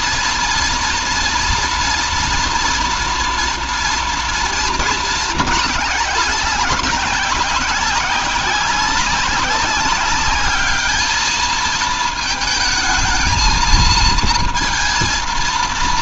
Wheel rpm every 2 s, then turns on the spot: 230, 240, 230, 200, 190, 210, 220, 230.
none